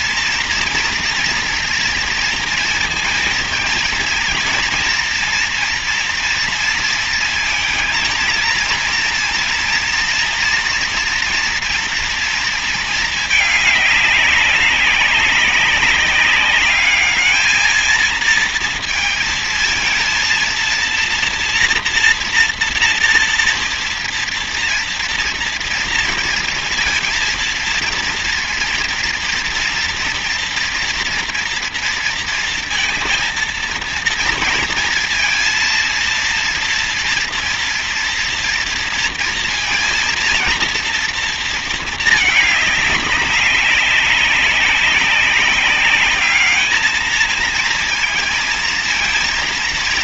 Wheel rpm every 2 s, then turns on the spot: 230, 230, 230, 230, 230, 230, 230, 200, 200, 220, 230, 230, 230, 230, 230, 230, 230, 230, 230, 230, 230, 210, 190, 210, 230.
none